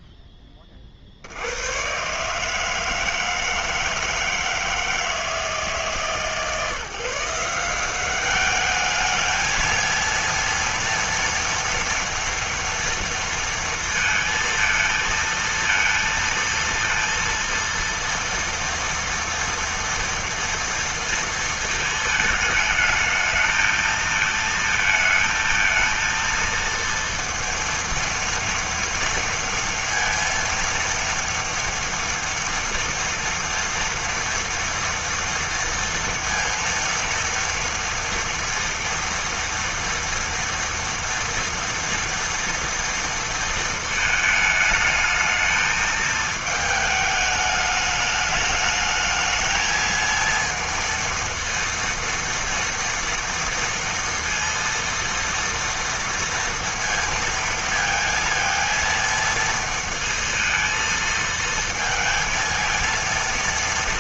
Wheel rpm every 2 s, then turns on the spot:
20, 150, 160, 140, 210, 230, 230, 230, 230, 230, 230, 220, 220, 230, 230, 230, 230, 230, 230, 230, 230, 230, 220, 220, 210, 230, 230, 230, 230, 230, 230, 230.
none